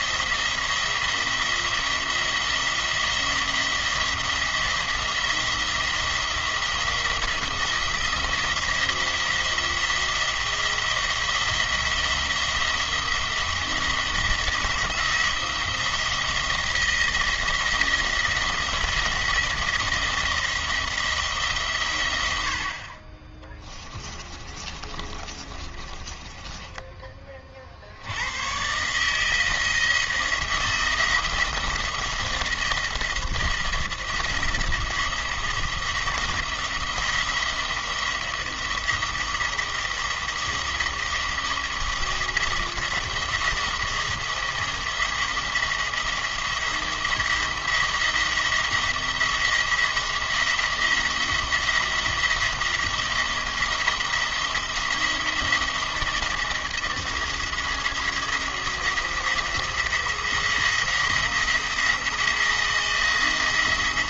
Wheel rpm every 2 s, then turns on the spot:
170, 170, 170, 170, 170, 170, 170, 170, 170, 170, 170, 60, 30, 20, 130, 170, 170, 170, 170, 170, 170, 170, 170, 170, 170, 170, 170, 170, 170, 170, 170, 170.
24-28